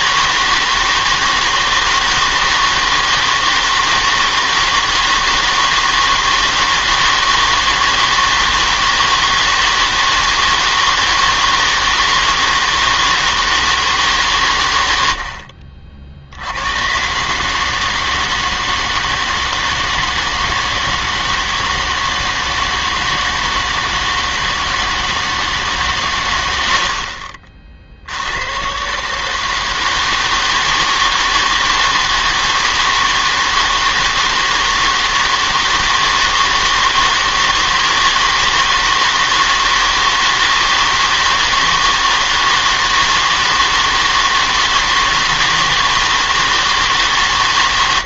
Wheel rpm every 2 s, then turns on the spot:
160, 160, 160, 160, 160, 160, 160, 110, 100, 160, 160, 160, 160, 80, 120, 160, 160, 160, 160, 160, 160, 160, 160, 160.
none